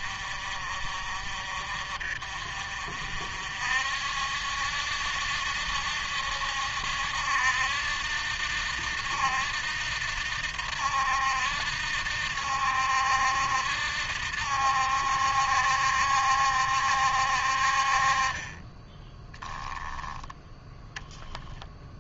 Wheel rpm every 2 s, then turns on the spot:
50, 50, 70, 70, 70, 70, 70, 70, 60, 20, 10.
none